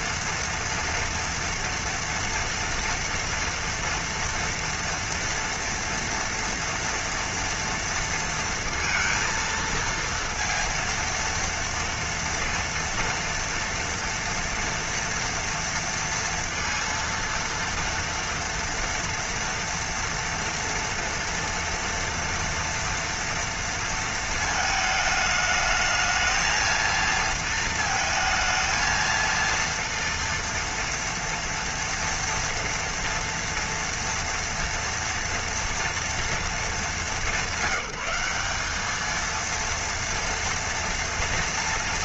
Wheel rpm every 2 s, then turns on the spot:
230, 230, 230, 230, 230, 230, 240, 230, 230, 230, 230, 230, 220, 230, 230, 230, 230, 230, 210, 210, 240.
none